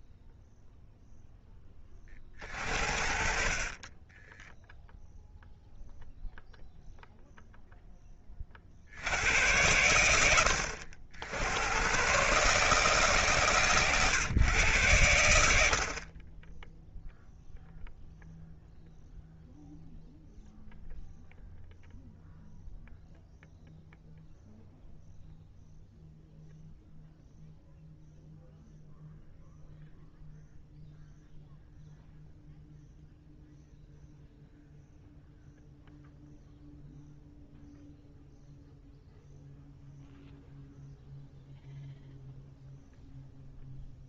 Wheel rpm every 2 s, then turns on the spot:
0, 70, 0, 0, 80, 90, 150, 100, 0, 0, 0, 0, 0, 0, 0, 0, 0, 0, 0, 0, 0, 0.
none